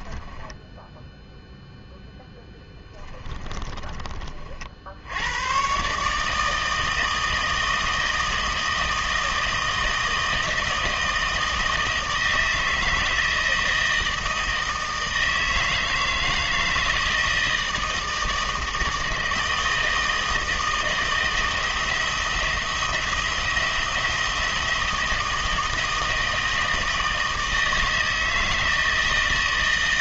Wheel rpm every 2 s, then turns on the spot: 10, 10, 50, 160, 160, 160, 160, 160, 160, 160, 160, 170, 170, 160, 160.
0-4